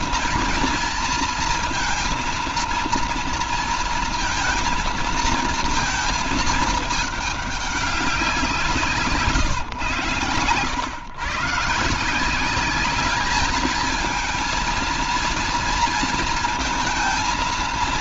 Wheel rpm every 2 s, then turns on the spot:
230, 230, 230, 210, 150, 130, 210, 230, 230.
none